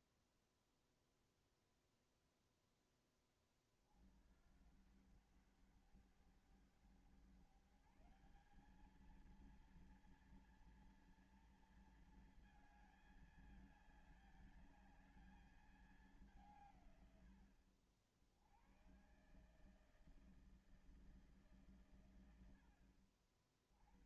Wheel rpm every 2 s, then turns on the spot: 0, 0, 70, 100, 190, 230, 220, 210, 180, 90, 160, 100.
none